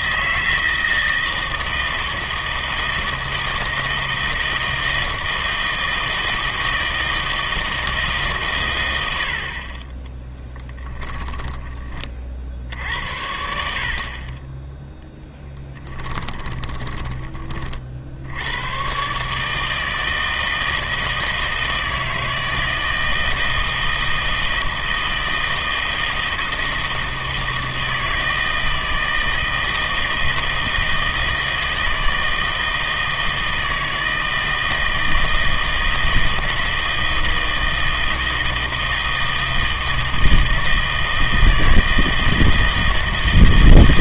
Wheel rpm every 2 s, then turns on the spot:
160, 160, 160, 160, 110, 10, 60, 10, 20, 110, 160, 160, 160, 160, 160, 160, 160, 160, 160, 160, 160, 160.
10-12 16-18